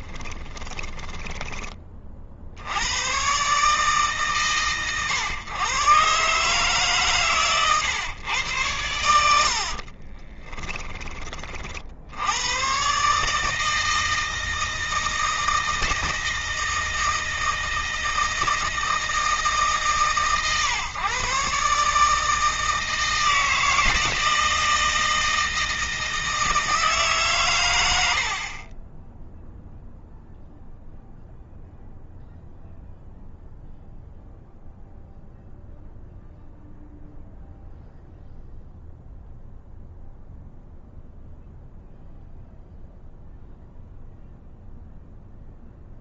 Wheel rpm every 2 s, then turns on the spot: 20, 100, 130, 140, 100, 10, 130, 160, 160, 160, 130, 160, 160, 150, 20, 0, 0, 0, 0, 0, 0, 0, 0.
0-2